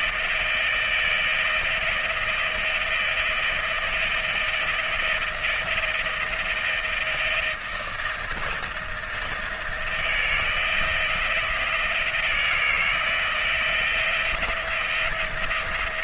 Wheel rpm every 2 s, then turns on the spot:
160, 160, 170, 170, 160, 170, 170, 170.
none